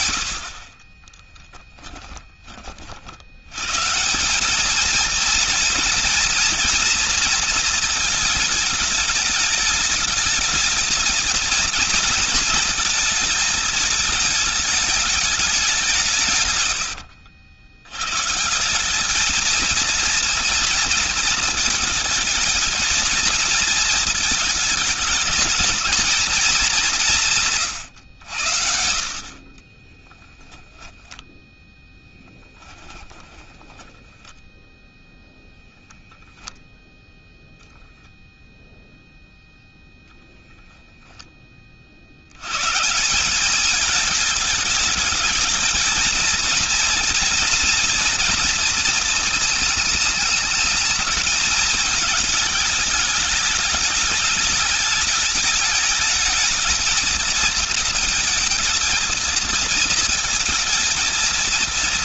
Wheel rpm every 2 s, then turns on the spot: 20, 50, 220, 230, 210, 220, 220, 220, 90, 180, 230, 220, 220, 190, 70, 10, 10, 0, 0, 0, 0, 130, 220, 230, 230, 220, 220, 210, 220, 230, 220.
0-2 16-18 30-34